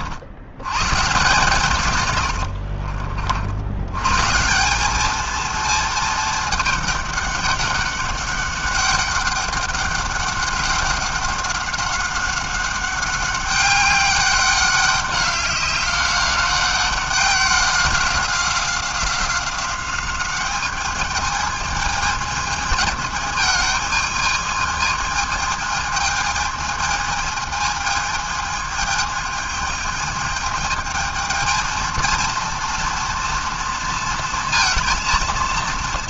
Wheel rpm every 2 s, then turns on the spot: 110, 50, 190, 210, 200, 200, 200, 200, 190, 190, 200, 220, 220, 220, 220, 220, 230, 230.
2-4